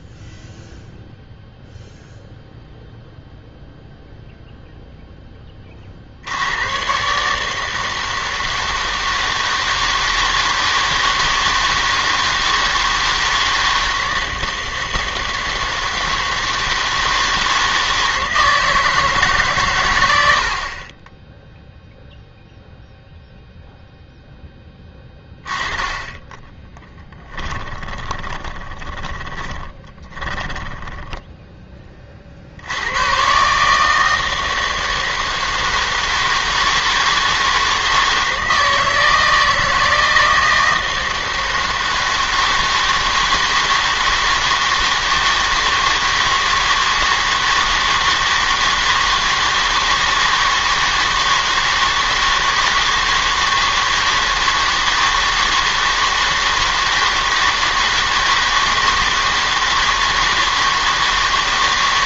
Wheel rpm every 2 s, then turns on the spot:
0, 0, 0, 100, 160, 160, 160, 160, 160, 160, 50, 0, 10, 10, 20, 10, 80, 160, 160, 160, 160, 160, 160, 160, 160, 160, 160, 160, 160, 160, 160.
26-32